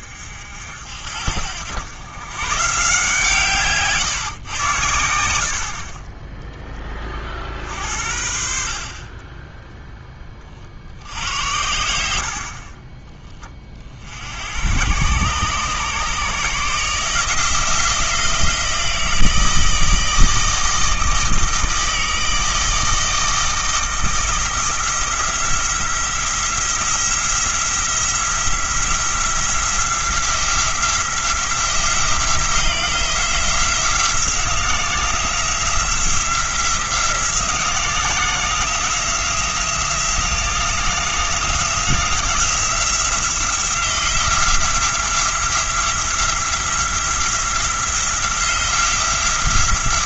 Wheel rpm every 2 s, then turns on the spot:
60, 140, 100, 10, 50, 50, 30, 100, 150, 170, 160, 160, 170, 170, 170, 170, 170, 180, 170, 170, 170, 170, 170, 180, 170.
12-14